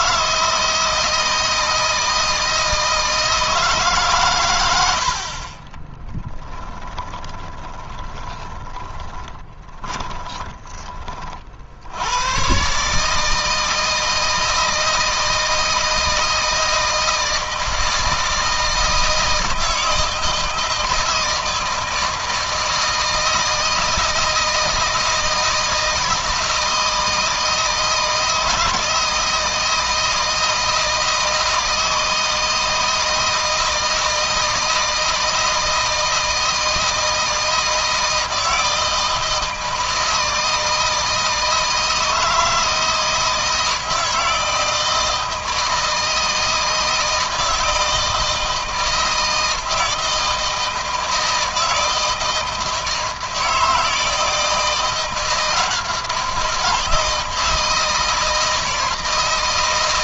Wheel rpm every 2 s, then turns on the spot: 160, 160, 80, 20, 10, 20, 150, 160, 160, 160, 160, 160, 160, 160, 160, 160, 160, 160, 160, 160, 160, 160, 160, 160, 160, 170, 160, 170, 170, 160.
4-10